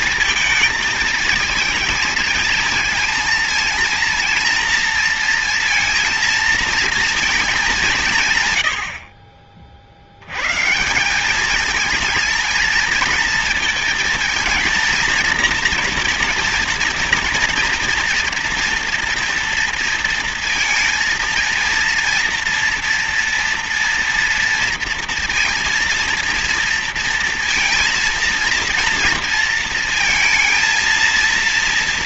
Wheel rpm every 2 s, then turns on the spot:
220, 230, 230, 230, 130, 110, 220, 230, 240, 230, 230, 230, 230, 230, 230, 230.
none